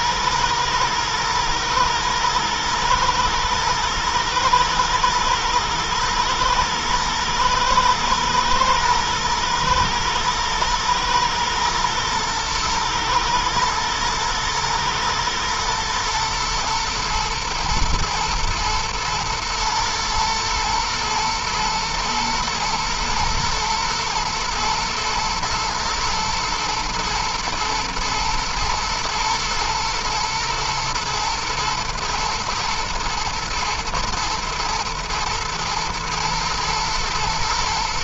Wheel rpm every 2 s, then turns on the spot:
110, 110, 120, 110, 120, 120, 120, 120, 120, 120, 110, 110, 120, 120, 120, 120, 120, 110, 110.
none